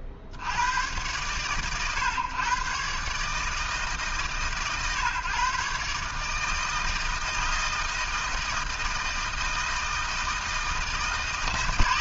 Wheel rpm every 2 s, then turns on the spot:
40, 120, 130, 160, 160, 160.
none